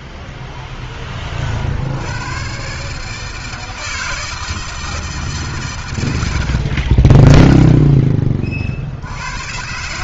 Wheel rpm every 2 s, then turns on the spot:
80, 160, 100, 20, 140.
none